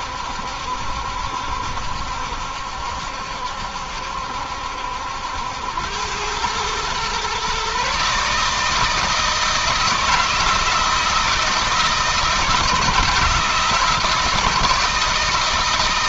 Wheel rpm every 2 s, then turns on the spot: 70, 70, 80, 120, 160, 160, 160, 160.
none